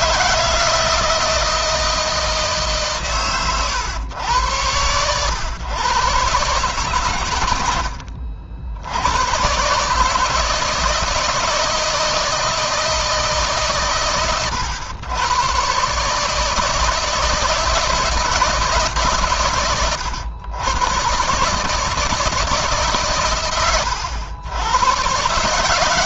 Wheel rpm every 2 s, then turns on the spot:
170, 150, 110, 130, 90, 160, 160, 100, 160, 150, 110, 150, 100.
none